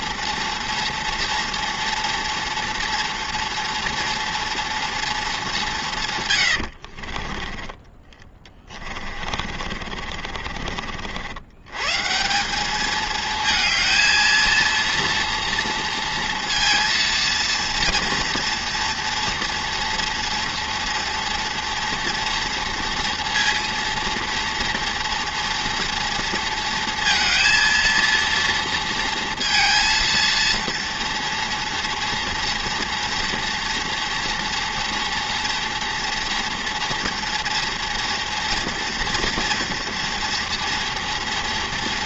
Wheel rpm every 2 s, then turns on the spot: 230, 230, 230, 50, 30, 60, 220, 230, 230, 230, 230, 230, 230, 230, 230, 230, 230, 230, 230, 230, 230.
6-10